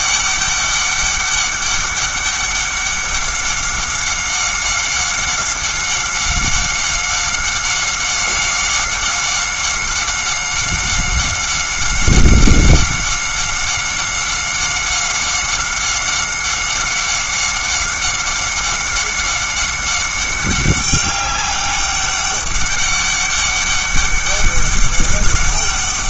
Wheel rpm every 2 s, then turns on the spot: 200, 190, 190, 190, 190, 190, 190, 190, 190, 190, 200, 200, 200.
none